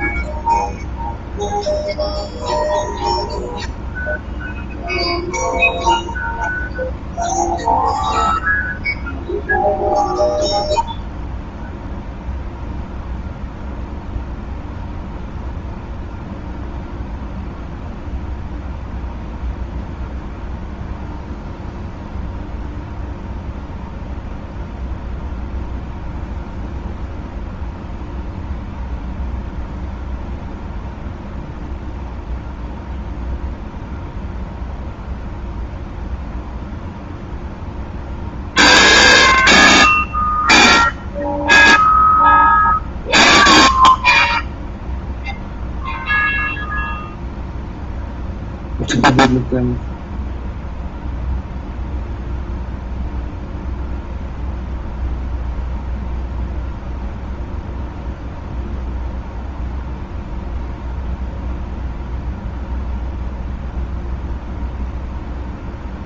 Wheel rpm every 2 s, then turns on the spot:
0, 0, 0, 0, 0, 0, 0, 0, 0, 0, 0, 0, 0, 0, 0, 0, 0, 0, 0, 0, 0, 0, 0, 0, 0, 0, 0, 0, 0, 0, 0, 0, 0.
none